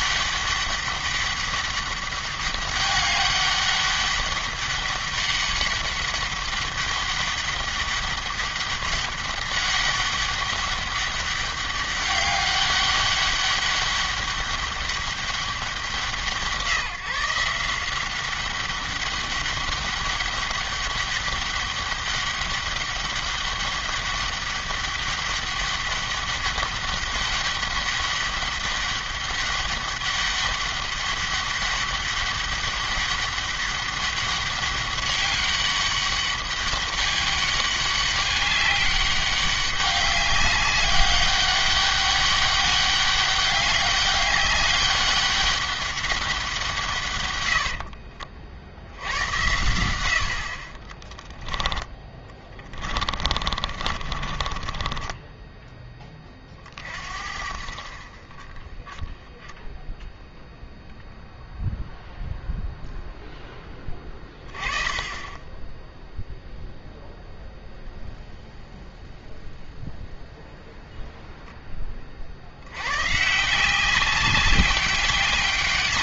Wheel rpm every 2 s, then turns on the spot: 200, 200, 200, 200, 200, 200, 200, 200, 150, 200, 200, 200, 200, 200, 200, 200, 200, 200, 200, 200, 200, 200, 200, 160, 70, 40, 20, 20, 50, 20, 0, 0, 20, 0, 0, 0, 100, 190.
50-56